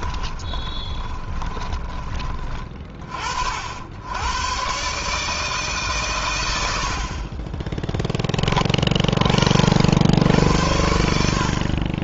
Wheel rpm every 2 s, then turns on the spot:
30, 30, 130, 90, 30, 90.
0-2